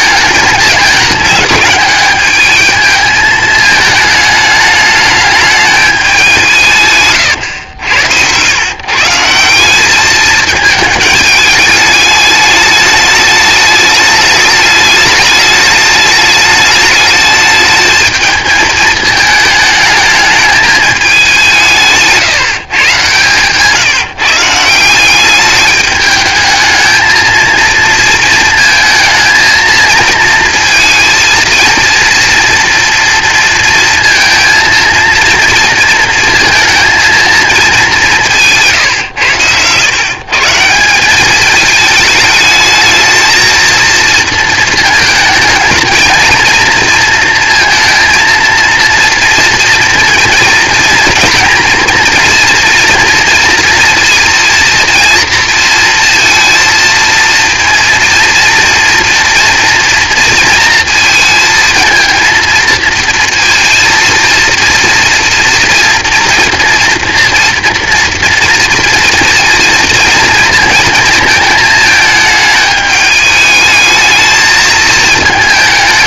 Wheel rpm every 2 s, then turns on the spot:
210, 210, 210, 160, 130, 210, 210, 210, 210, 220, 210, 140, 170, 220, 220, 230, 230, 230, 230, 160, 180, 220, 230, 230, 230, 230, 230, 230, 230, 230, 230, 230, 230, 230, 230, 230, 210, 220.
none